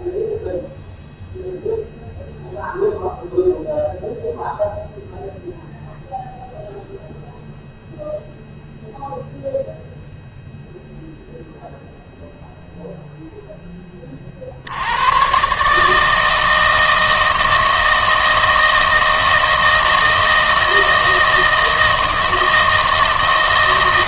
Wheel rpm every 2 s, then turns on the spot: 0, 0, 0, 0, 0, 0, 0, 80, 160, 160, 160, 160.
none